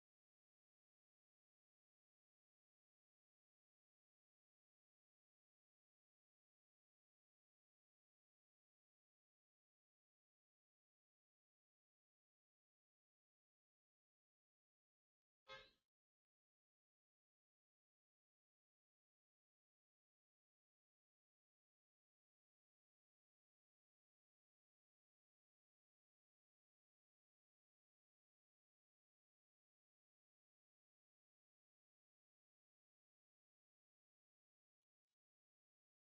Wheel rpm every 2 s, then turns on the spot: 0, 0, 0, 0, 0, 0, 0, 0, 0, 0, 0, 0, 0, 0, 0, 0, 0, 0.
none